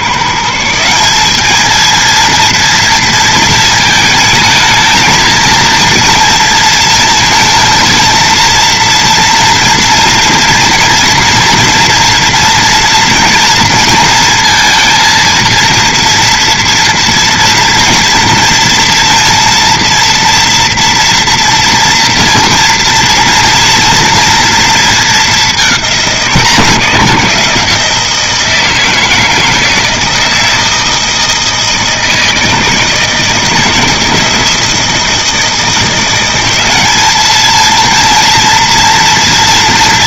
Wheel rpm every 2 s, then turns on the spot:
160, 230, 220, 230, 230, 230, 230, 230, 230, 230, 230, 230, 230, 180, 160, 160, 160, 160, 190, 230.
none